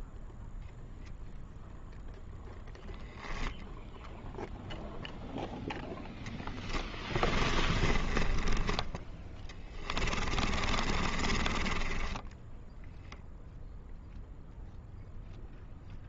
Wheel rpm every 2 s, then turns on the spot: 0, 0, 0, 10, 10, 30, 0, 0.
6-8 10-12